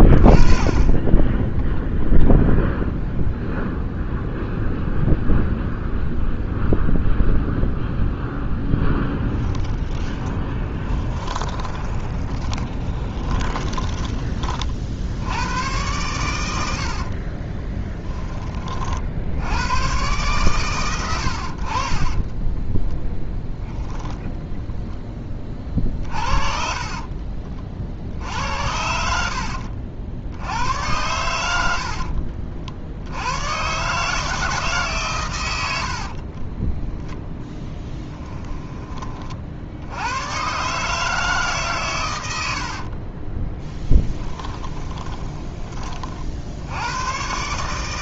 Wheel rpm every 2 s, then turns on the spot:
20, 0, 0, 0, 10, 20, 20, 50, 60, 40, 110, 10, 10, 40, 70, 90, 70, 150, 10, 20, 140, 60, 30, 90.
8-14 16-18 22-24 26-28 36-38 42-46